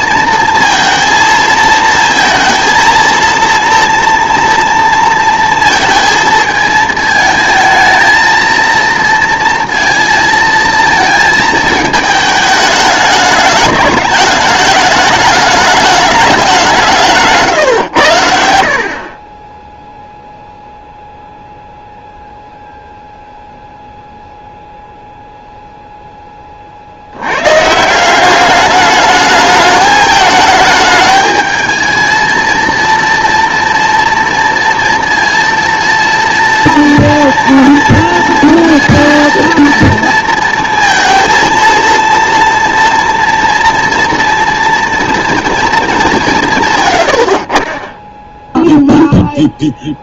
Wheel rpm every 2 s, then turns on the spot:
230, 230, 230, 220, 230, 220, 210, 210, 180, 50, 0, 0, 0, 40, 200, 210, 230, 230, 230, 230, 230, 230, 230, 130, 0.
none